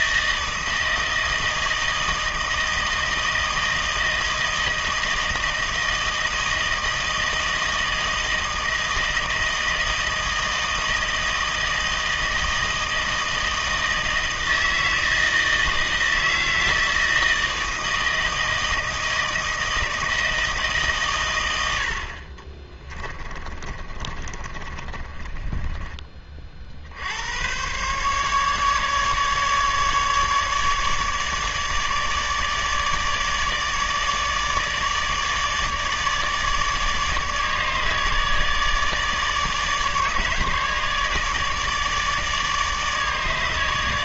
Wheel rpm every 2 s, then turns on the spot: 160, 160, 160, 160, 160, 160, 160, 160, 160, 160, 150, 30, 30, 50, 150, 150, 150, 150, 150, 150, 150, 150.
22-26